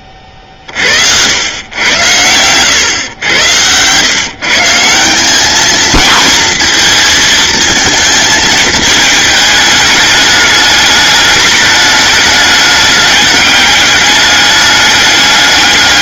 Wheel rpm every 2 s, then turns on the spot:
60, 110, 170, 230, 220, 210, 210, 210.
2-4